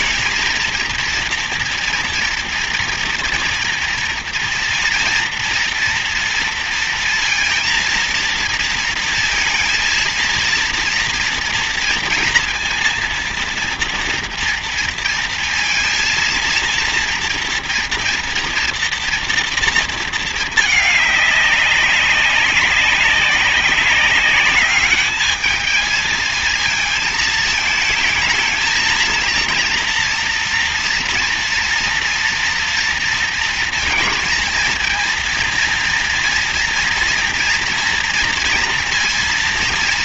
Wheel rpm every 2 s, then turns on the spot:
230, 230, 230, 230, 230, 230, 230, 230, 230, 230, 220, 200, 200, 220, 220, 240, 240, 220, 230, 230.
none